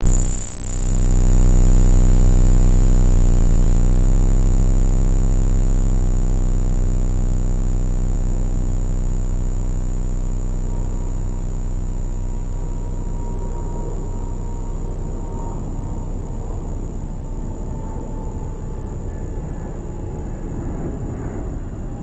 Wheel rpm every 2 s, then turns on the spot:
0, 0, 0, 0, 0, 0, 0, 0, 0, 0, 0.
none